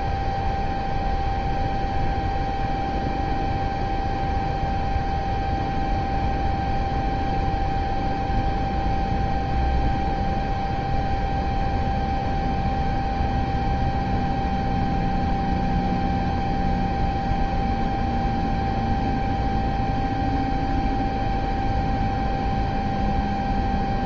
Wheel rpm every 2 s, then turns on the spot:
0, 0, 0, 0, 0, 0, 0, 0, 0, 0, 0, 0.
none